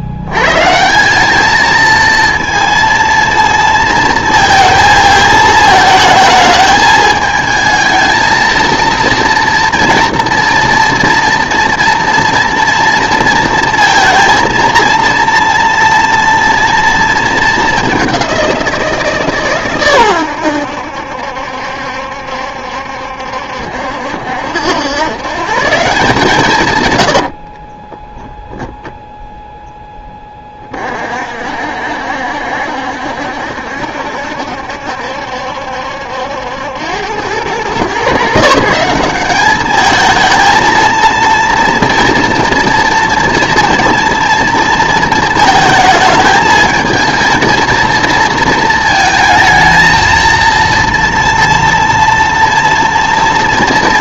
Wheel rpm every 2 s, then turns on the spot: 150, 230, 220, 220, 230, 230, 230, 230, 230, 180, 90, 70, 90, 130, 10, 40, 70, 70, 80, 170, 220, 230, 230, 220, 230, 230, 230.
none